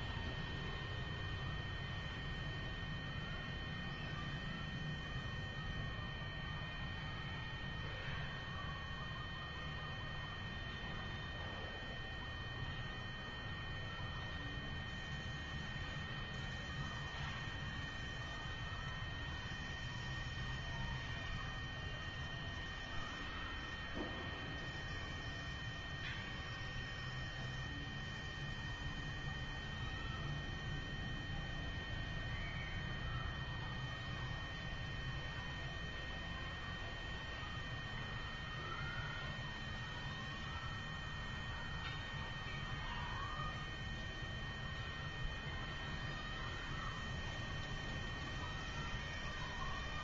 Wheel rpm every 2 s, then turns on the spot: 0, 0, 0, 0, 0, 0, 0, 0, 0, 0, 0, 0, 0, 0, 0, 0, 0, 0, 0, 0, 0, 0, 0, 0, 0.
none